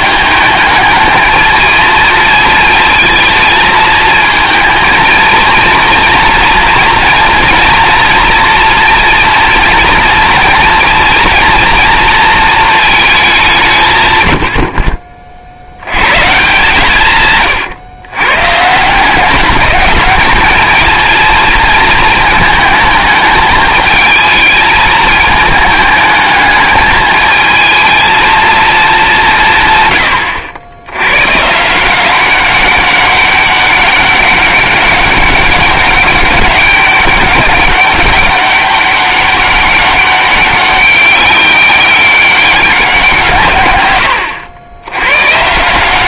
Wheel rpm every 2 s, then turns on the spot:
220, 220, 230, 230, 230, 230, 220, 50, 150, 150, 210, 220, 220, 210, 220, 70, 190, 200, 200, 200, 200, 190, 90.
none